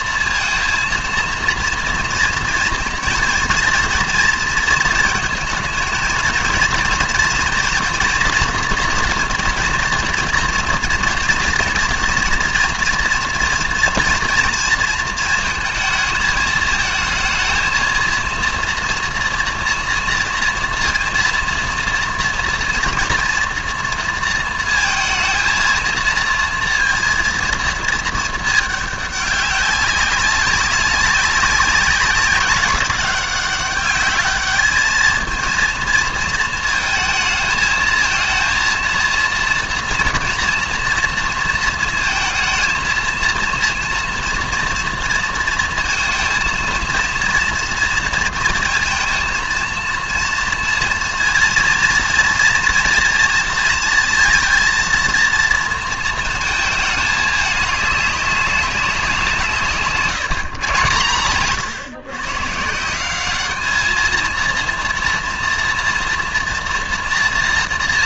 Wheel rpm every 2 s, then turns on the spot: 230, 230, 230, 230, 230, 230, 230, 230, 220, 230, 230, 230, 230, 230, 210, 200, 190, 210, 220, 220, 230, 230, 230, 230, 230, 230, 230, 220, 220, 200, 140, 150, 230, 230.
none